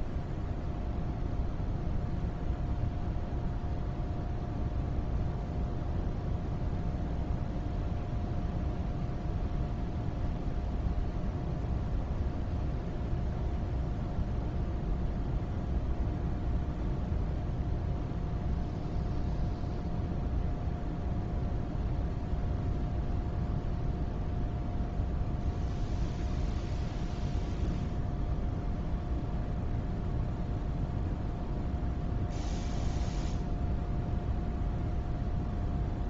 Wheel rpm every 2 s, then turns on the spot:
0, 0, 0, 0, 0, 0, 0, 0, 0, 0, 0, 0, 0, 0, 0, 0, 0, 0.
none